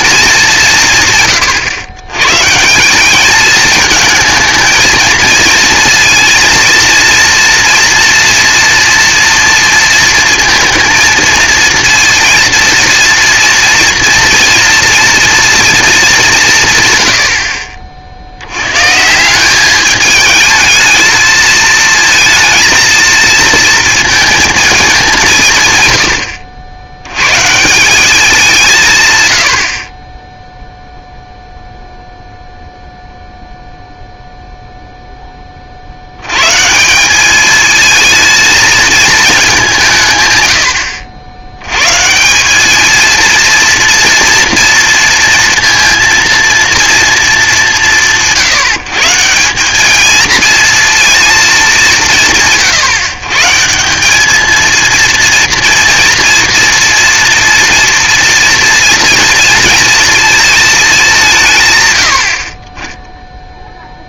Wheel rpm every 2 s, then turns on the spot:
180, 160, 220, 230, 230, 220, 230, 230, 160, 110, 220, 230, 220, 80, 160, 0, 0, 0, 140, 220, 90, 210, 230, 240, 150, 230, 140, 220, 230, 230, 220, 20.
none